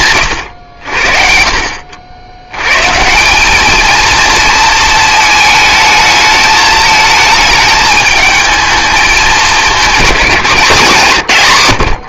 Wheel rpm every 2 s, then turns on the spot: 80, 140, 220, 220, 220, 170.
none